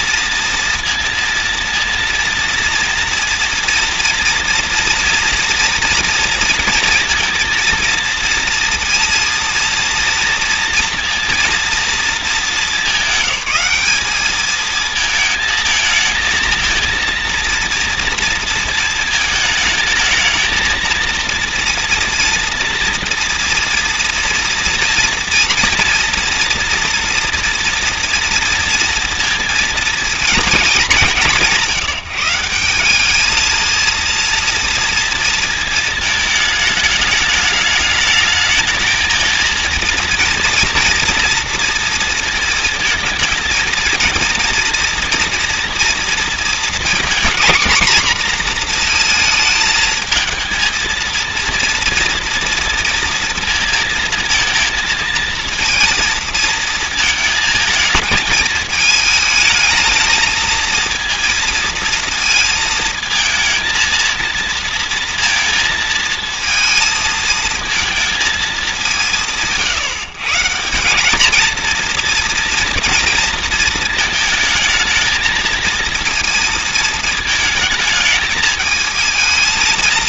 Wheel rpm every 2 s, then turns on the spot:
230, 230, 230, 230, 230, 230, 220, 210, 220, 230, 220, 240, 230, 230, 240, 230, 180, 230, 220, 210, 230, 230, 220, 230, 240, 220, 230, 230, 230, 220, 220, 230, 230, 230, 230, 150, 240, 220, 230, 220.
none